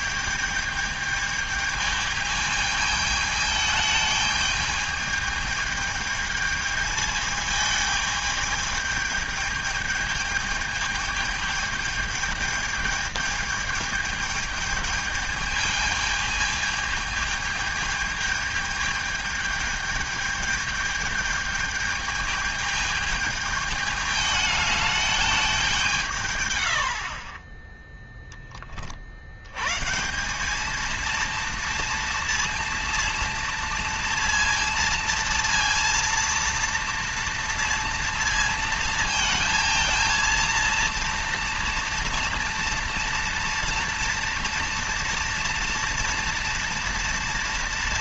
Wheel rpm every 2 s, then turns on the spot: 210, 210, 210, 220, 210, 210, 220, 210, 210, 210, 220, 210, 210, 80, 30, 210, 230, 230, 230, 230, 230, 230, 230, 230.
none